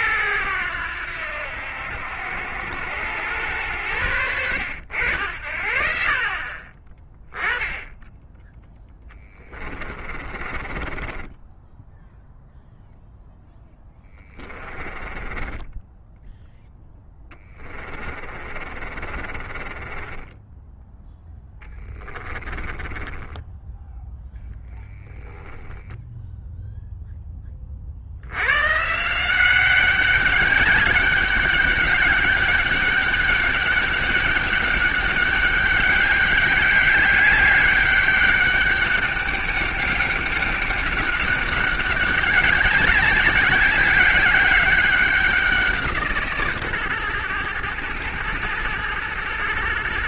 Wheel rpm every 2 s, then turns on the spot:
90, 90, 80, 30, 10, 30, 0, 20, 10, 40, 10, 20, 0, 0, 140, 200, 200, 200, 200, 200, 200, 200, 190, 120, 110.
8-12 14-16 18-20 22-24